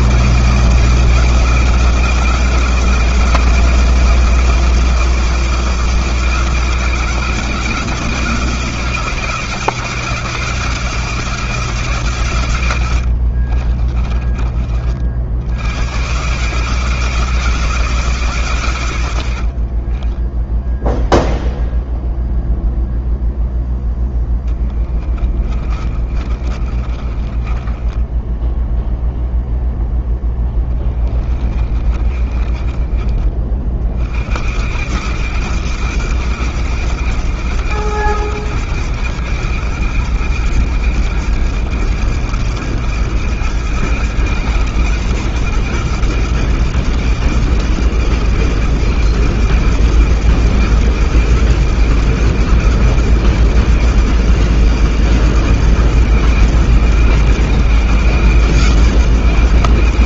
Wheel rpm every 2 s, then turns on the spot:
150, 160, 160, 160, 160, 180, 100, 40, 150, 120, 0, 0, 10, 30, 0, 20, 30, 110, 100, 100, 100, 100, 100, 100, 110, 110, 100, 100, 110, 110.
12-14 24-28 30-32